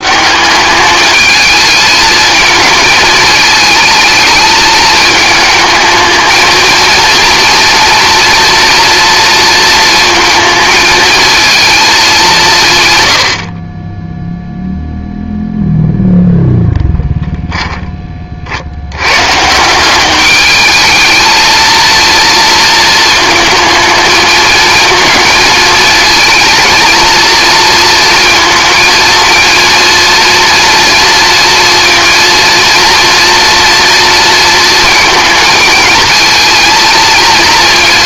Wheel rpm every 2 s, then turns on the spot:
210, 220, 210, 230, 230, 220, 120, 0, 0, 90, 210, 230, 220, 220, 230, 230, 240, 230, 220.
none